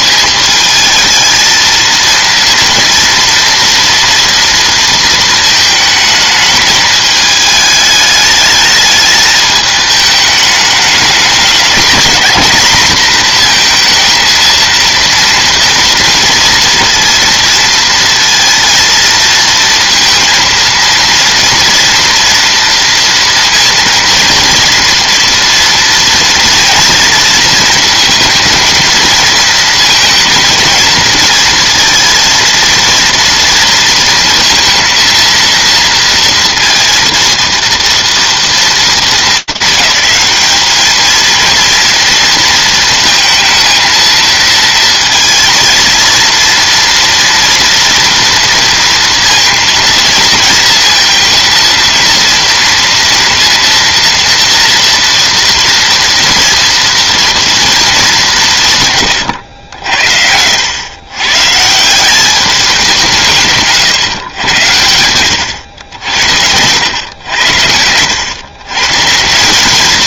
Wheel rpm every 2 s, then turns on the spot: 220, 230, 230, 220, 210, 210, 220, 230, 230, 230, 230, 240, 230, 230, 230, 230, 230, 230, 230, 230, 210, 230, 230, 230, 230, 230, 230, 230, 230, 150, 100, 190, 110, 100, 140.
none